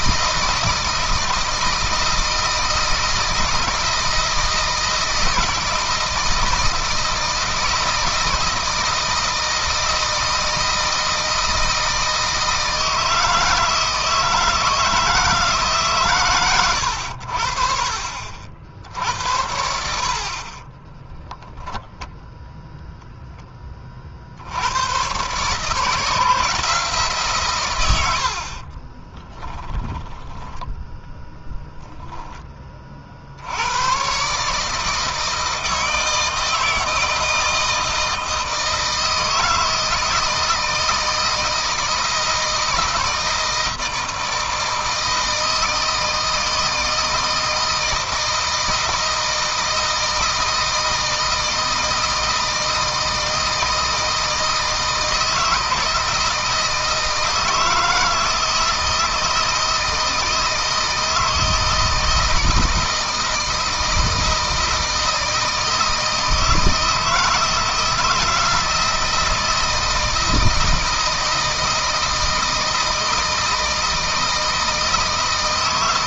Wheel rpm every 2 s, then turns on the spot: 160, 160, 160, 160, 160, 160, 160, 160, 90, 70, 20, 0, 110, 150, 30, 10, 30, 150, 160, 160, 160, 160, 160, 160, 160, 160, 160, 160, 160, 160, 160, 160, 160, 160, 160, 160, 160, 160.
20-22 28-32